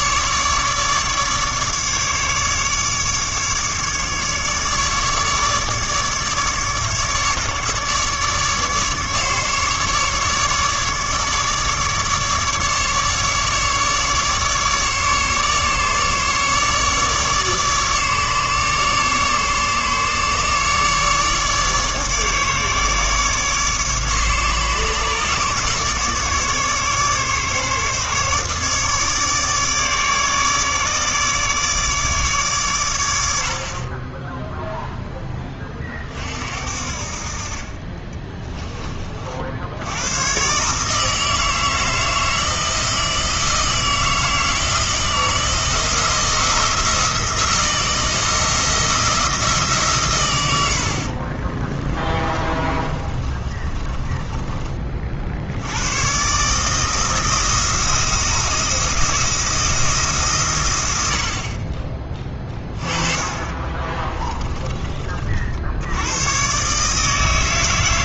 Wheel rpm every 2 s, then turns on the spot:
150, 150, 150, 150, 150, 150, 150, 150, 150, 150, 150, 150, 150, 140, 150, 150, 100, 10, 50, 30, 160, 160, 160, 170, 170, 60, 30, 40, 160, 170, 90, 20, 30, 150.
50-54 62-64